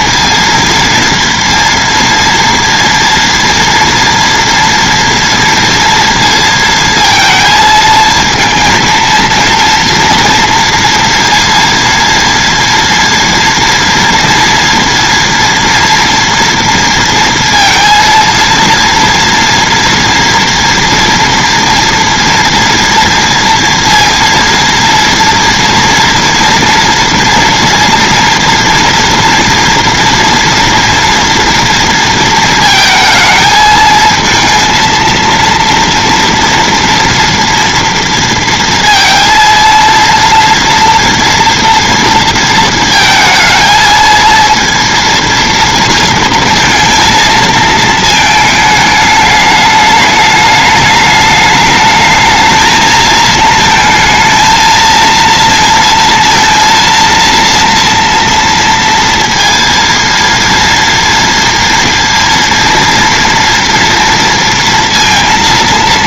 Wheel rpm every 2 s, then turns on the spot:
230, 230, 230, 230, 230, 230, 240, 230, 230, 230, 230, 230, 230, 230, 230, 230, 220, 230, 230, 230, 230, 220, 230, 230, 210, 210, 220, 230, 230, 230, 230, 230, 230.
none